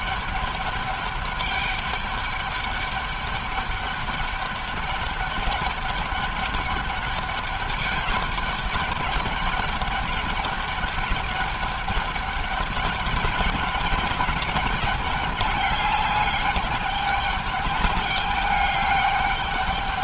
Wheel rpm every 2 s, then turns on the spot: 210, 200, 210, 200, 200, 200, 200, 200, 200, 200.
none